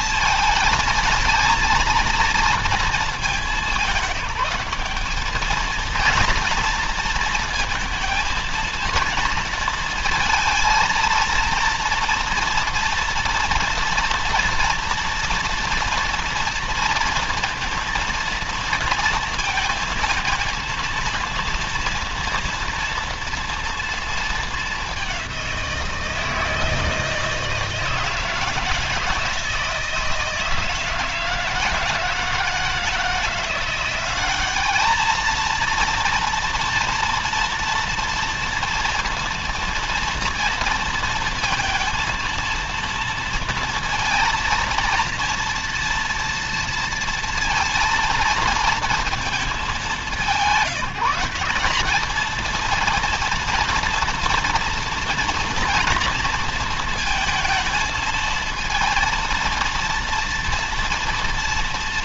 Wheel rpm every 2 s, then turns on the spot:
230, 230, 210, 230, 230, 230, 230, 230, 230, 230, 230, 230, 200, 160, 160, 160, 170, 210, 230, 230, 230, 230, 230, 230, 230, 190, 230, 240, 230, 220, 230.
none